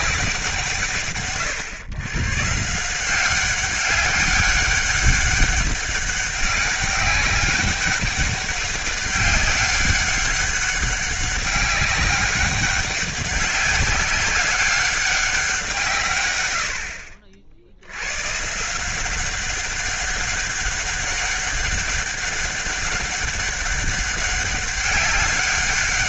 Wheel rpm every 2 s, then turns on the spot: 150, 140, 200, 200, 200, 200, 200, 200, 90, 150, 200, 200, 200.
none